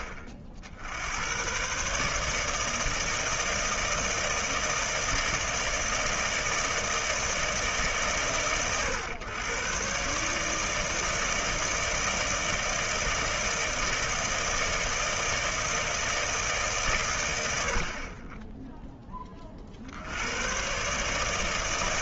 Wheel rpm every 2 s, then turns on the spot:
70, 160, 160, 160, 120, 150, 160, 160, 130, 20, 140.
none